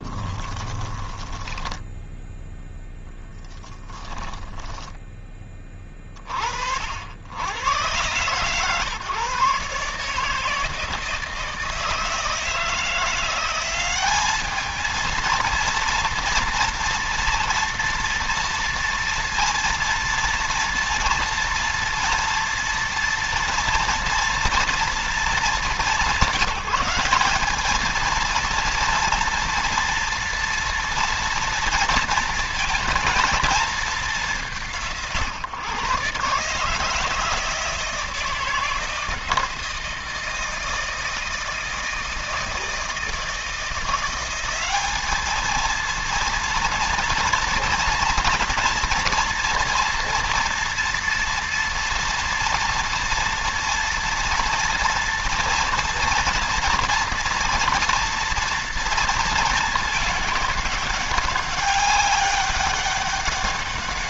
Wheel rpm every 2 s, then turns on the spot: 20, 10, 10, 40, 130, 160, 160, 220, 230, 230, 240, 240, 230, 190, 230, 230, 230, 150, 150, 160, 160, 160, 210, 230, 230, 230, 240, 230, 240, 230, 200, 200.
0-2 4-6